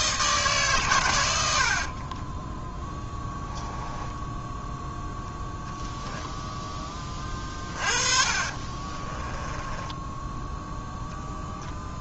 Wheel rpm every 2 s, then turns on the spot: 140, 10, 0, 10, 30, 10.
2-4 8-10